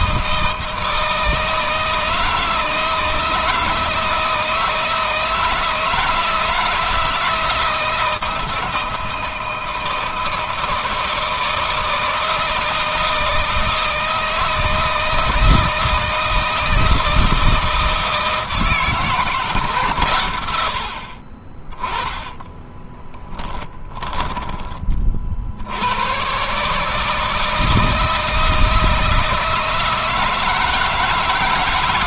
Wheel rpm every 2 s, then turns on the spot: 160, 160, 160, 160, 170, 160, 160, 160, 160, 160, 70, 20, 30, 150, 160, 160.
22-24